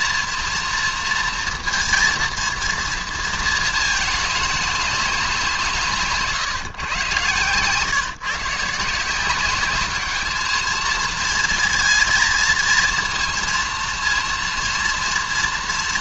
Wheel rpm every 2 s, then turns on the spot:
230, 230, 200, 140, 150, 220, 230, 230.
none